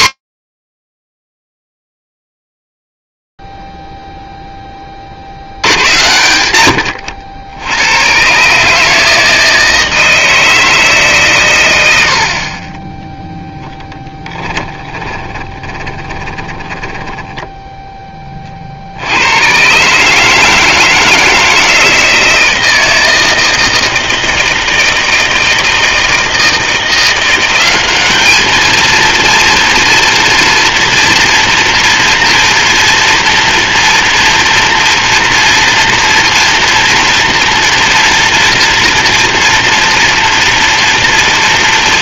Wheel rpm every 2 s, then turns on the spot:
10, 0, 10, 90, 160, 160, 20, 20, 10, 90, 160, 160, 160, 180, 230, 230, 230, 240, 230, 230, 230.
14-18